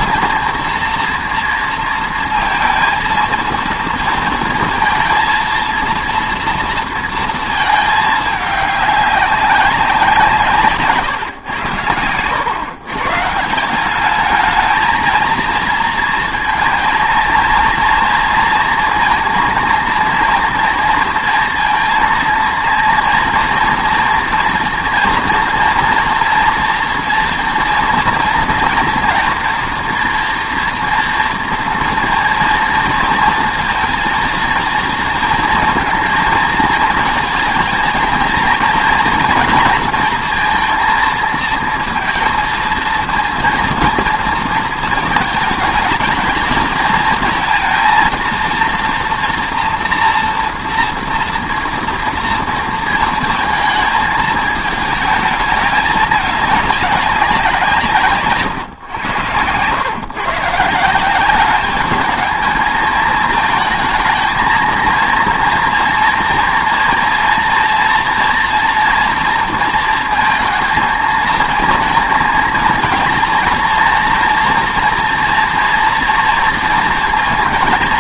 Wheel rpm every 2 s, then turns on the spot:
230, 230, 230, 230, 200, 150, 120, 220, 230, 230, 230, 230, 230, 230, 230, 230, 230, 230, 230, 230, 230, 230, 220, 220, 230, 230, 230, 220, 200, 120, 170, 220, 230, 230, 230, 230, 230, 240, 230.
none